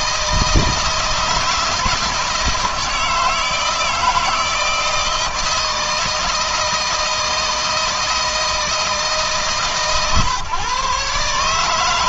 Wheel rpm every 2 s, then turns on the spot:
160, 160, 160, 160, 160, 140.
none